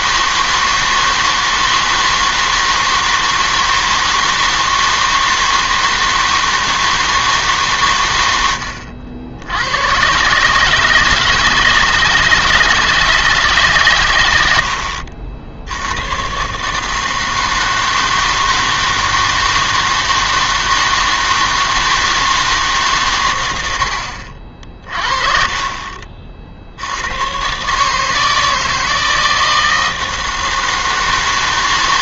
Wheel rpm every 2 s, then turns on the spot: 160, 160, 160, 160, 80, 150, 160, 70, 140, 160, 160, 150, 40, 60, 160, 160.
none